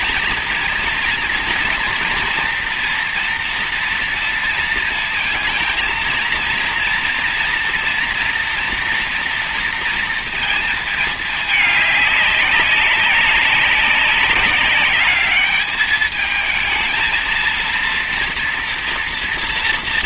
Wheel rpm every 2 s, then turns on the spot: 230, 230, 230, 230, 230, 220, 190, 200, 220, 240.
none